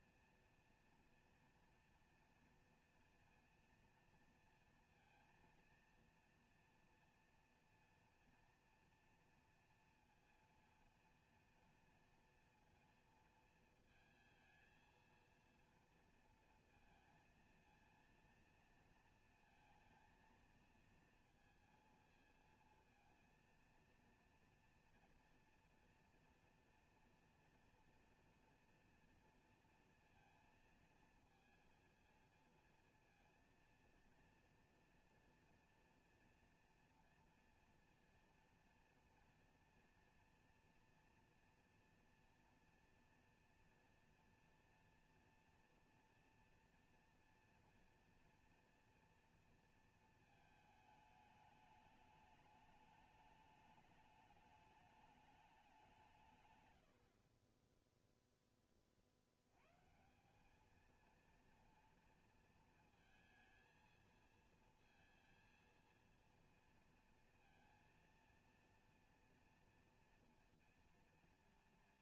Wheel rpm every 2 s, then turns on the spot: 230, 230, 230, 230, 230, 230, 230, 230, 230, 230, 230, 230, 230, 230, 240, 230, 230, 230, 230, 230, 230, 230, 230, 230, 240, 220, 210, 210, 150, 0, 180, 230, 230, 230, 230, 240.
none